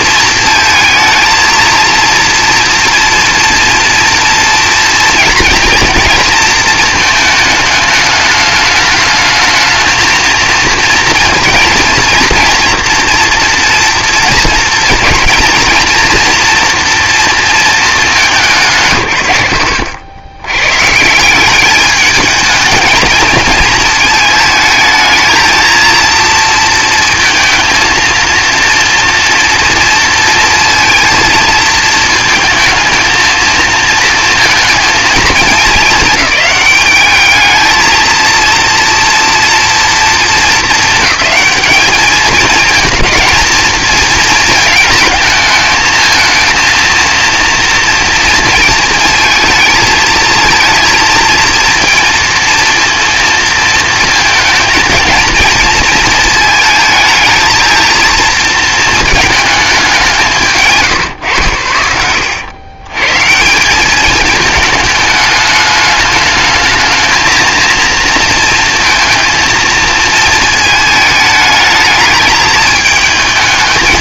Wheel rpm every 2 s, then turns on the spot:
230, 230, 230, 220, 210, 230, 230, 230, 240, 130, 120, 220, 220, 230, 240, 230, 220, 230, 210, 230, 220, 220, 220, 230, 230, 230, 230, 220, 220, 230, 160, 110, 210, 220, 230, 220, 210.
60-62